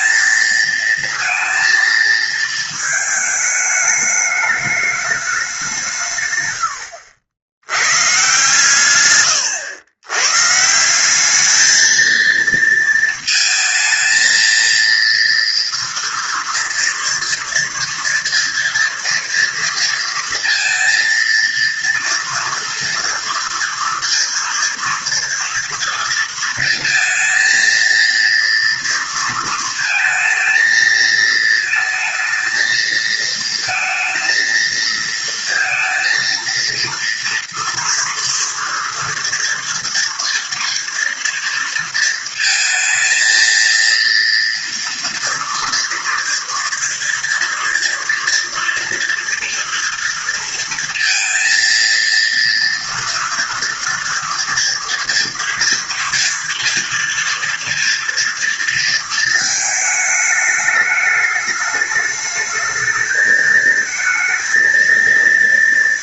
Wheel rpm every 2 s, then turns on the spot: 230, 220, 210, 90, 120, 190, 230, 230, 230, 230, 230, 230, 230, 230, 230, 230, 220, 230, 230, 230, 230, 220, 230, 230, 230, 230, 230, 230, 230, 220, 210, 220, 230.
none